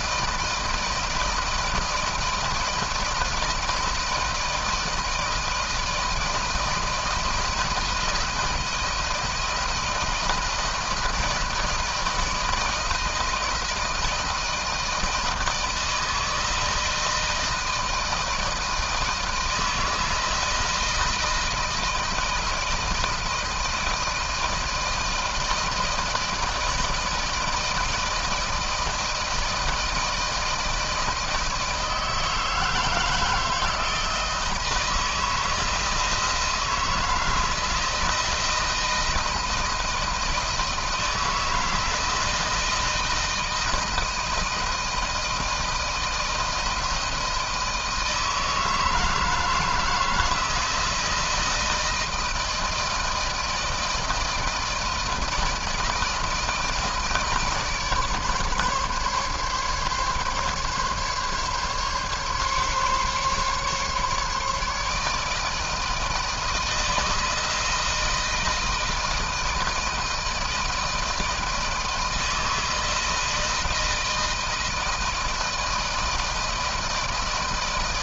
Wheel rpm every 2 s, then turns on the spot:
160, 160, 160, 160, 160, 160, 160, 160, 160, 160, 160, 160, 160, 160, 160, 160, 160, 160, 160, 160, 160, 160, 170, 160, 160, 160, 160, 160, 160, 150, 140, 140, 150, 160, 160, 160, 160, 160, 160.
none